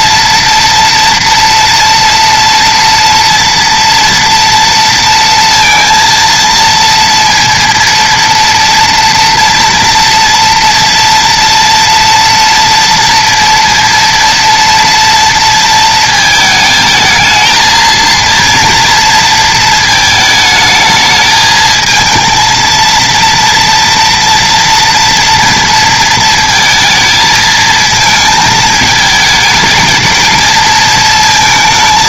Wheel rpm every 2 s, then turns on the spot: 230, 230, 230, 230, 230, 230, 230, 230, 220, 230, 220, 230, 230, 220, 220, 230.
none